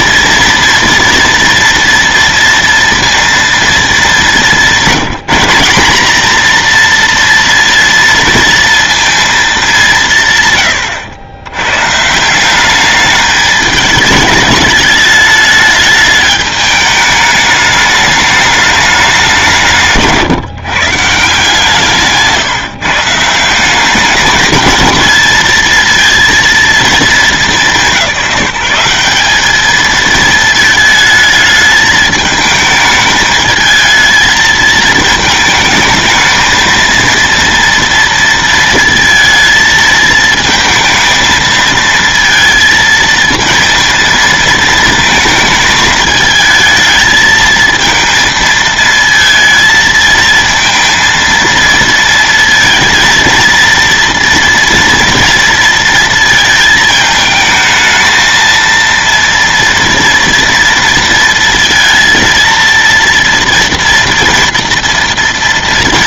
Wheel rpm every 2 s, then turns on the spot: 230, 230, 200, 240, 230, 120, 200, 210, 210, 210, 150, 150, 220, 220, 190, 220, 210, 220, 230, 230, 220, 230, 230, 220, 220, 230, 230, 230, 220, 230, 230, 230, 230.
none